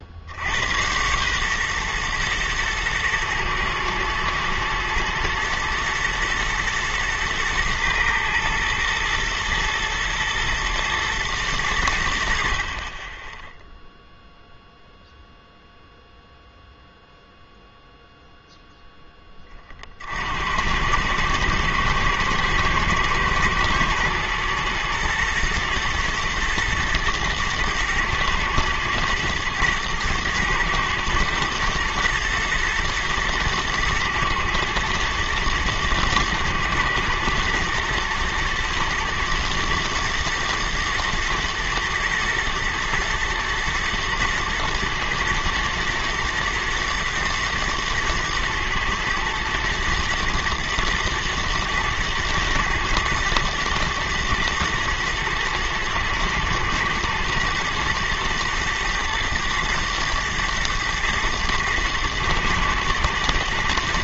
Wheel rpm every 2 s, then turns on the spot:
80, 110, 110, 110, 110, 110, 60, 0, 0, 0, 70, 120, 120, 120, 110, 120, 120, 110, 110, 110, 110, 110, 110, 110, 120, 110, 120, 120, 110, 110, 120, 120.
none